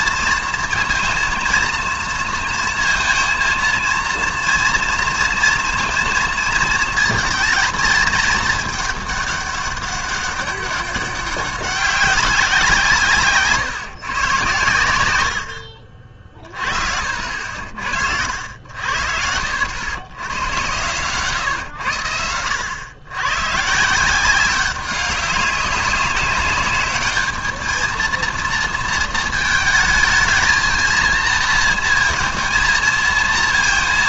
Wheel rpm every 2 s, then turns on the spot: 230, 230, 230, 230, 220, 200, 180, 120, 50, 80, 110, 100, 190, 200, 230, 220, 220.
none